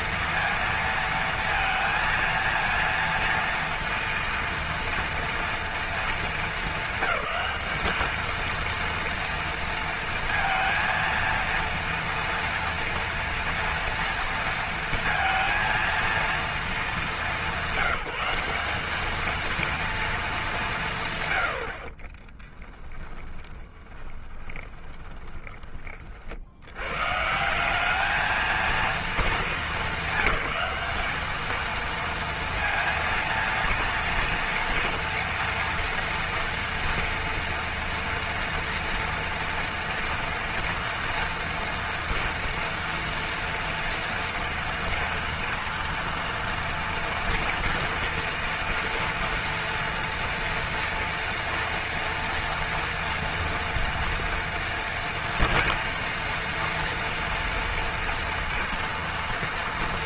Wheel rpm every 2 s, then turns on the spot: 230, 230, 230, 220, 220, 230, 230, 230, 230, 190, 220, 30, 20, 50, 220, 200, 230, 230, 230, 230, 230, 230, 230, 230, 230, 230, 230, 230, 230, 230.
22-26